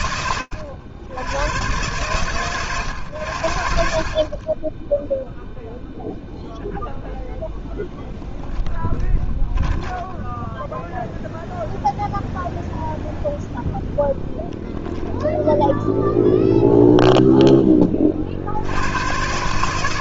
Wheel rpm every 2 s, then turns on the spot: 70, 90, 0, 0, 20, 0, 0, 0, 0, 110.
8-10